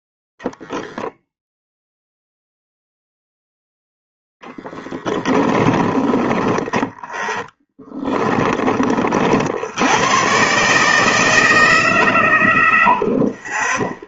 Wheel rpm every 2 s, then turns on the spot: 0, 0, 10, 10, 20, 120, 30.
6-10